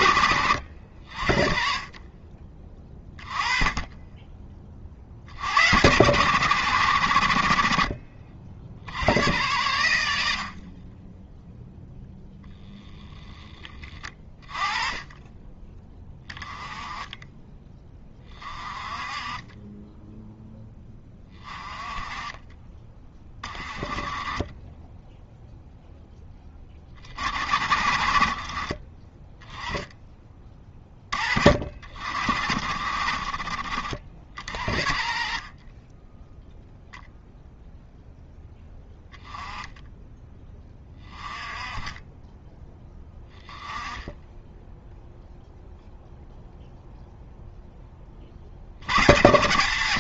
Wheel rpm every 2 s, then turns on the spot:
70, 20, 50, 100, 70, 30, 10, 20, 20, 30, 10, 30, 10, 40, 20, 30, 50, 50, 0, 10, 20, 10, 0, 0, 100.
12-14